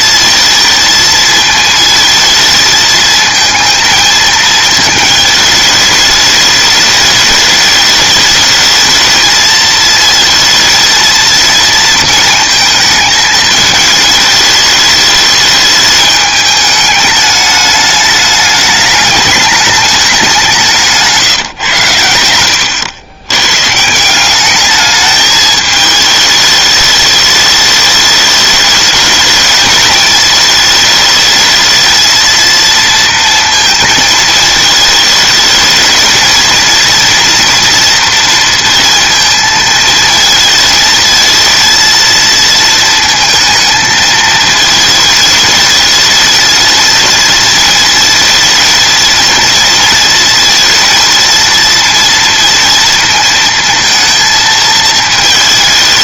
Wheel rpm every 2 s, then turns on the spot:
220, 230, 220, 220, 210, 220, 230, 220, 210, 210, 210, 140, 130, 220, 210, 220, 220, 230, 210, 240, 230, 230, 230, 220, 230, 230, 230, 230.
none